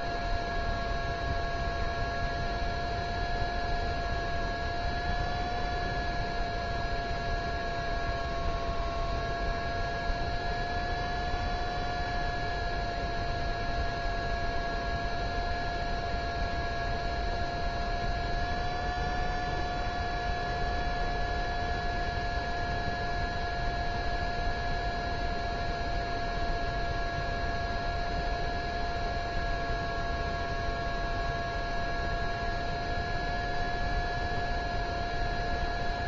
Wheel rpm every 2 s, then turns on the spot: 0, 0, 0, 0, 0, 0, 0, 0, 0, 0, 0, 0, 0, 0, 0, 0, 0, 0.
none